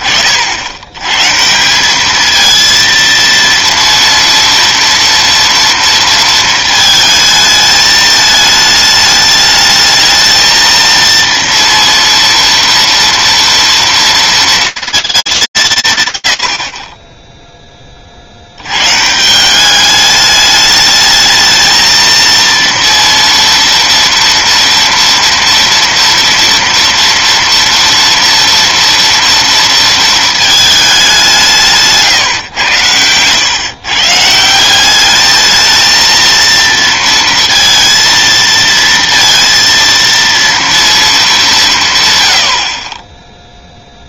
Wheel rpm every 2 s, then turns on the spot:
50, 230, 240, 220, 210, 220, 230, 230, 90, 100, 210, 230, 230, 230, 230, 220, 110, 180, 230, 230, 230, 60.
none